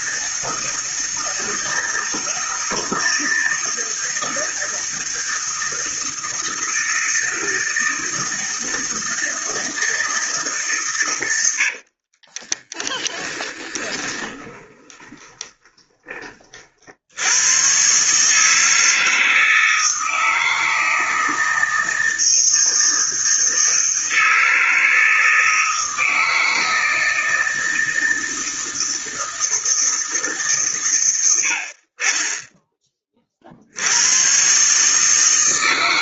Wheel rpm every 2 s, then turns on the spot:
160, 160, 160, 160, 160, 140, 20, 20, 40, 160, 160, 160, 160, 160, 160, 140, 20, 140.
12-16